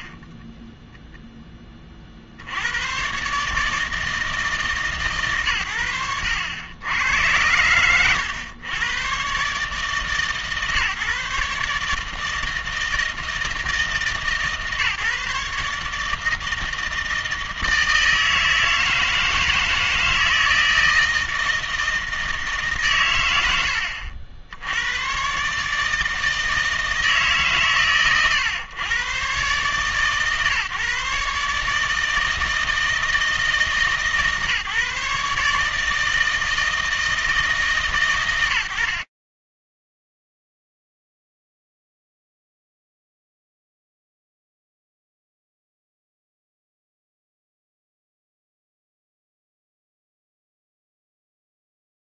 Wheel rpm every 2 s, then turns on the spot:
20, 100, 150, 90, 110, 140, 160, 150, 160, 160, 160, 140, 90, 160, 110, 140, 160, 150, 160, 90, 0, 0, 0, 0, 0, 0.
0-2